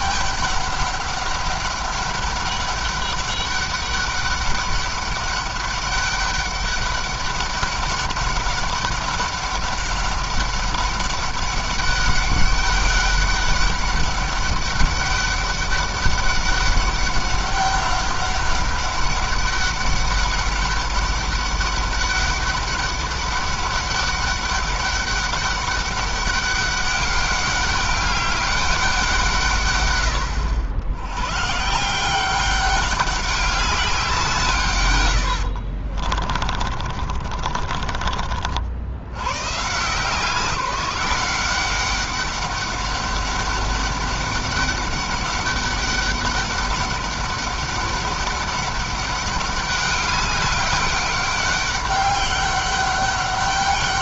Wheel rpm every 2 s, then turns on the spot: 200, 200, 200, 200, 200, 200, 200, 200, 200, 200, 200, 190, 200, 200, 190, 90, 200, 130, 30, 60, 180, 200, 200, 200, 200, 200, 200.
34-38